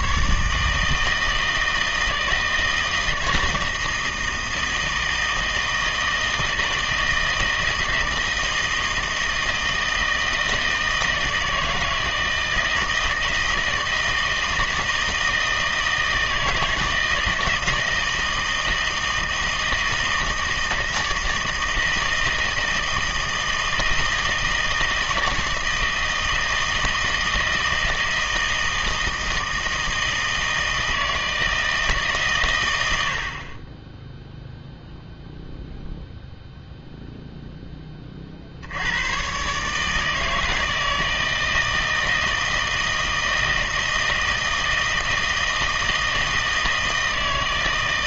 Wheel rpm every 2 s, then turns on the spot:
150, 160, 160, 160, 160, 160, 160, 160, 160, 160, 160, 160, 160, 160, 160, 160, 100, 0, 0, 60, 160, 160, 160, 160.
none